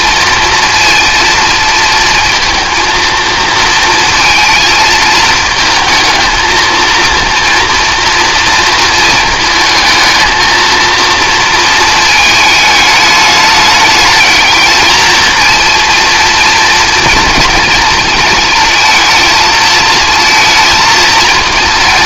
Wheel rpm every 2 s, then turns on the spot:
230, 230, 220, 220, 230, 230, 210, 220, 230, 230, 230.
none